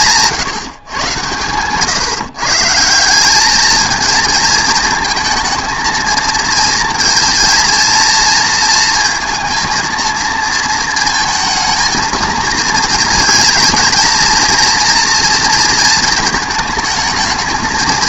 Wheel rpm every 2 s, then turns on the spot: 150, 150, 220, 230, 230, 230, 230, 230, 220.
none